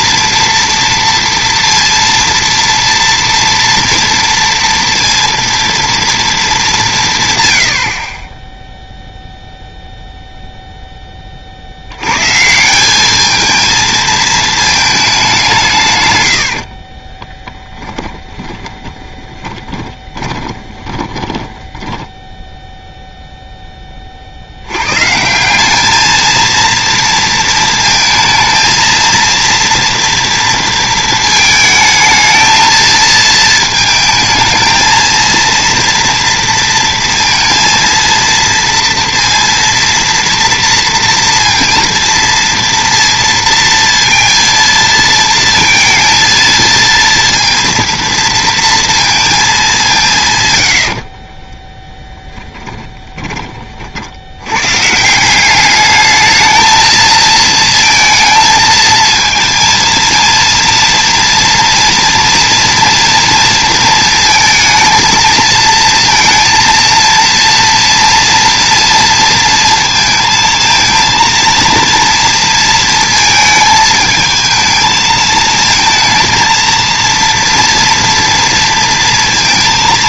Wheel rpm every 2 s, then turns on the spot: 230, 230, 230, 190, 0, 0, 170, 220, 50, 30, 20, 0, 90, 230, 220, 230, 220, 220, 230, 230, 230, 230, 230, 230, 230, 100, 10, 110, 220, 220, 230, 230, 230, 230, 240, 230, 230, 220, 230, 230.
16-22 52-54